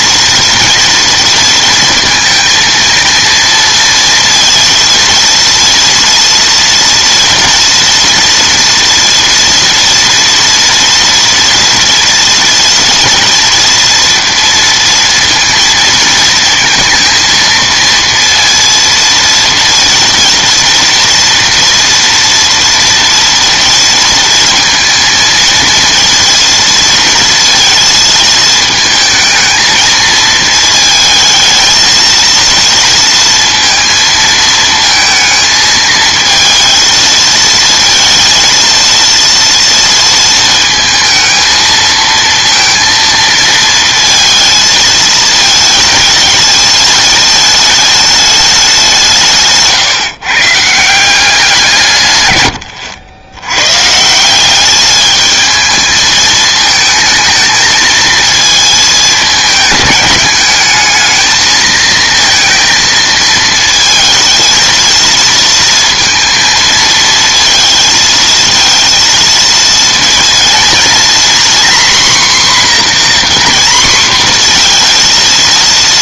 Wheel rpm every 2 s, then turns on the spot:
240, 230, 230, 230, 230, 230, 240, 230, 230, 230, 230, 240, 230, 230, 220, 220, 230, 220, 220, 230, 220, 230, 220, 220, 190, 170, 90, 210, 220, 210, 210, 230, 220, 230, 230, 240, 260, 230.
none